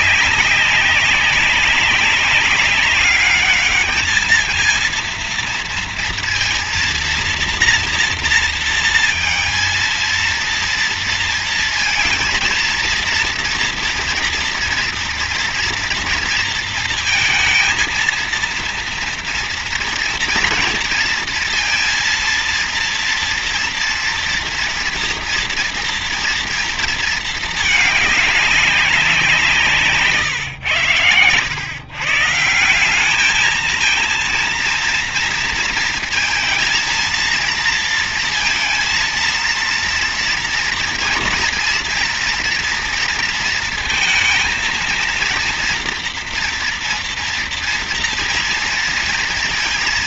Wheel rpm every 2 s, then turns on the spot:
200, 190, 220, 230, 230, 230, 230, 230, 230, 230, 230, 230, 240, 230, 210, 130, 160, 230, 230, 230, 230, 230, 230, 230, 230.
none